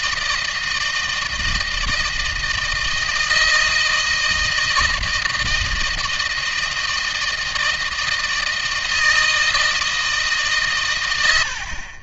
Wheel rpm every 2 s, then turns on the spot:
160, 160, 160, 160, 160, 140.
none